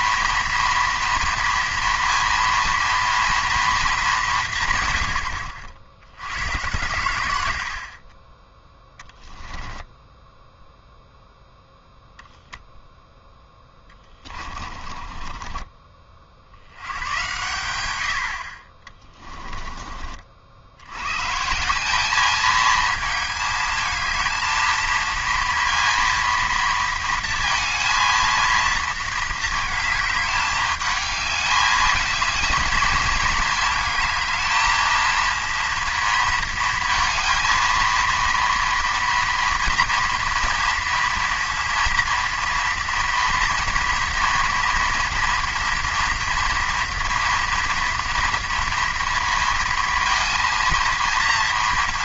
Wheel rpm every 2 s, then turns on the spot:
230, 230, 140, 110, 10, 0, 0, 30, 70, 40, 70, 220, 220, 230, 230, 210, 220, 220, 230, 230, 230, 230, 230, 230, 230, 230.
14-16